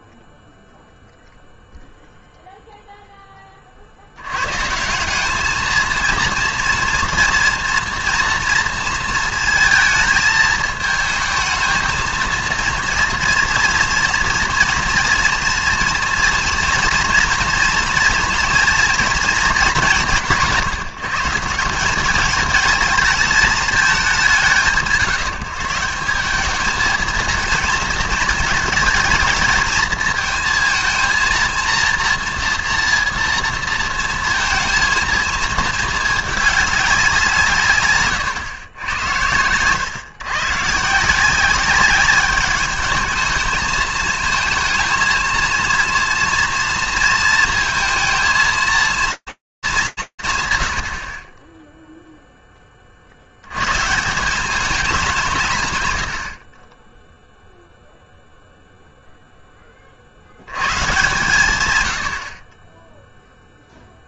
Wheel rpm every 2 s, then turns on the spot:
0, 0, 120, 230, 230, 220, 230, 230, 230, 230, 170, 220, 170, 200, 220, 220, 230, 230, 210, 120, 130, 210, 220, 230, 220, 20, 50, 190, 10, 10, 120, 40.
none